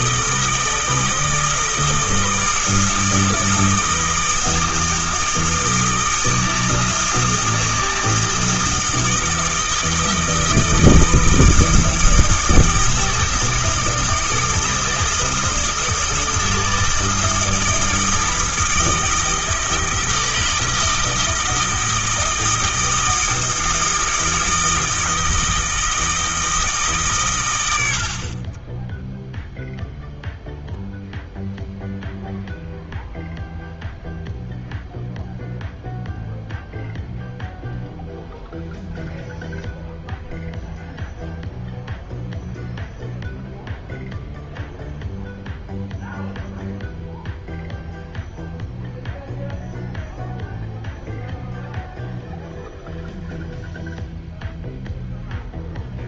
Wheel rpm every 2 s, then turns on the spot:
160, 160, 160, 160, 160, 160, 160, 160, 160, 160, 160, 160, 160, 140, 10, 0, 0, 0, 0, 0, 0, 0, 0, 0, 0, 0, 0, 0.
none